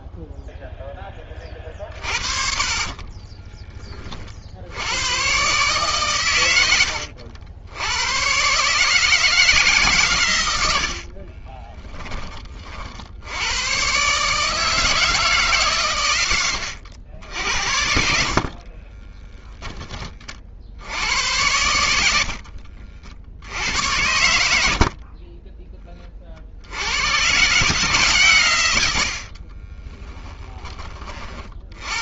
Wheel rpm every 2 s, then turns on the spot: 0, 40, 60, 100, 130, 110, 20, 150, 90, 50, 40, 70, 90, 40, 130, 10.
2-4 16-20 22-24 30-32